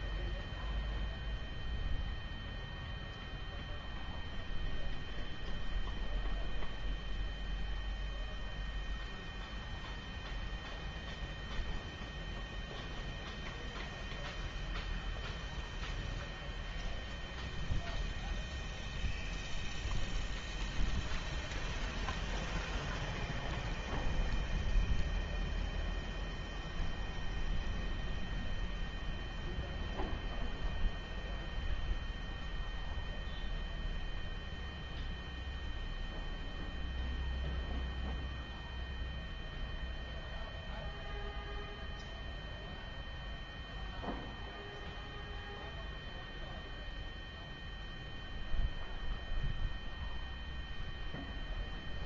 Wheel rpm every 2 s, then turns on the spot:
0, 0, 0, 0, 0, 0, 0, 0, 0, 0, 0, 0, 0, 0, 0, 0, 0, 0, 0, 0, 0, 0, 0, 0, 0, 0.
none